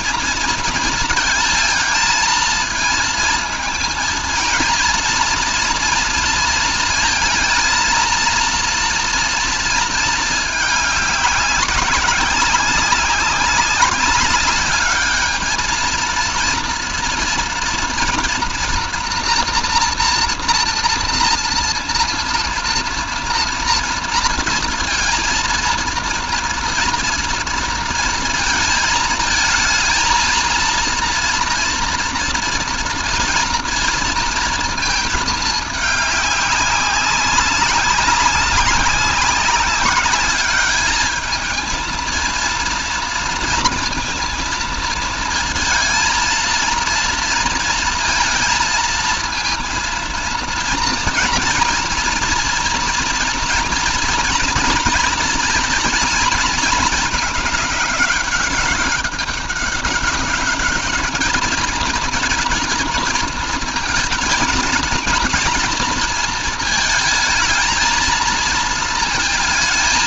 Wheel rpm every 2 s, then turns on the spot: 230, 230, 230, 220, 230, 210, 190, 200, 230, 230, 230, 230, 230, 230, 220, 230, 230, 230, 200, 200, 210, 230, 220, 230, 230, 230, 230, 230, 220, 200, 210, 230, 220, 220, 230.
none